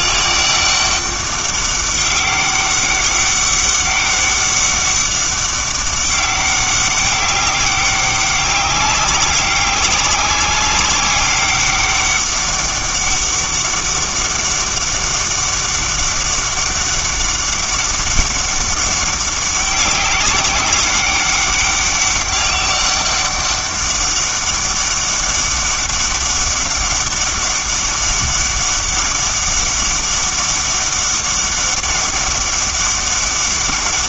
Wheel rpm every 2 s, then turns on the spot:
200, 200, 200, 200, 200, 190, 200, 200, 190, 200, 200, 200, 200, 200, 200, 200, 200.
none